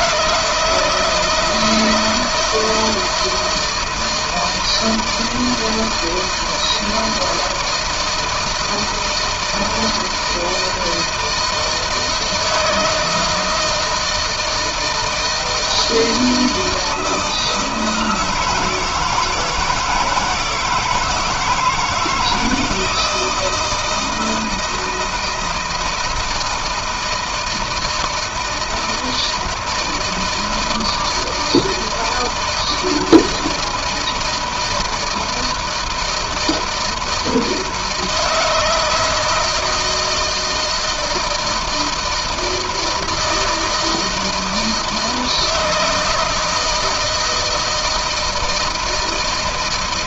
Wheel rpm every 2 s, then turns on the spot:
160, 160, 160, 160, 160, 170, 160, 160, 160, 160, 170, 160, 160, 160, 160, 160, 160, 160, 160, 160, 160, 160, 160, 160, 160.
none